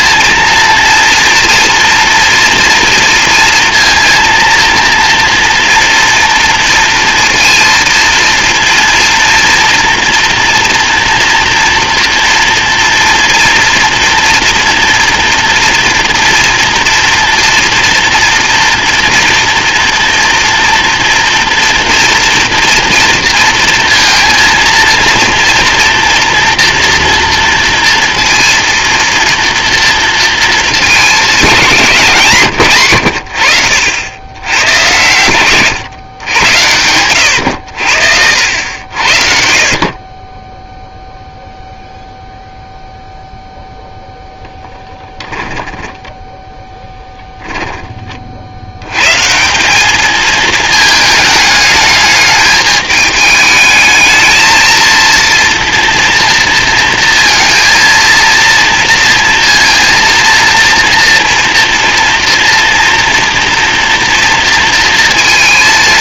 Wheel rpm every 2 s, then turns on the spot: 230, 230, 230, 230, 230, 230, 230, 230, 230, 230, 230, 230, 230, 240, 230, 220, 120, 90, 100, 70, 10, 0, 10, 10, 80, 220, 210, 230, 230, 230, 230, 240, 230.
46-48